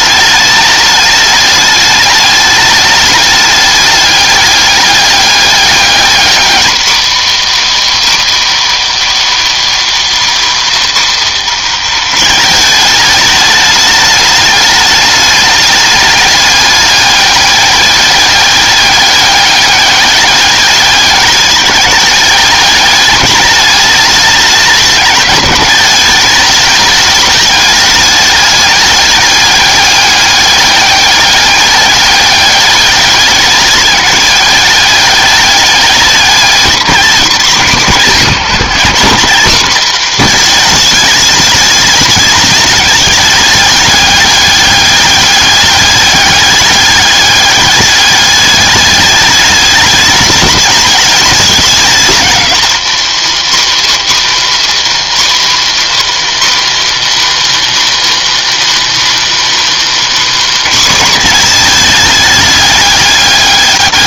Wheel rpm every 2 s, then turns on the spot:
210, 210, 200, 230, 300, 270, 210, 210, 200, 200, 200, 200, 210, 210, 210, 200, 200, 200, 200, 170, 220, 210, 200, 200, 200, 210, 210, 270, 280, 300, 260, 210.
none